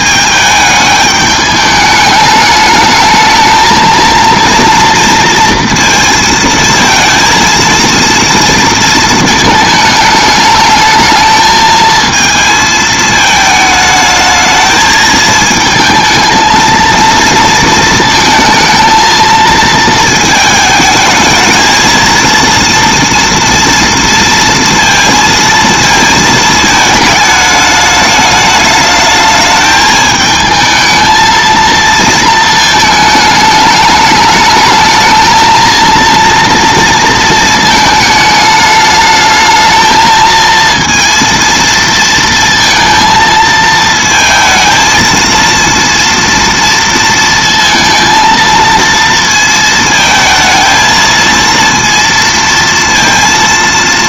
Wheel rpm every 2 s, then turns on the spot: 210, 210, 240, 230, 230, 210, 220, 220, 230, 230, 220, 230, 230, 220, 210, 220, 220, 220, 230, 210, 230, 230, 230, 230, 230, 220, 230.
none